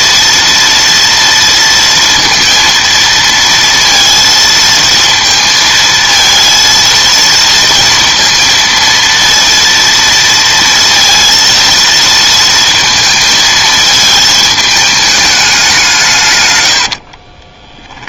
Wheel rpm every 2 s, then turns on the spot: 230, 230, 230, 230, 230, 230, 230, 220, 110.
16-18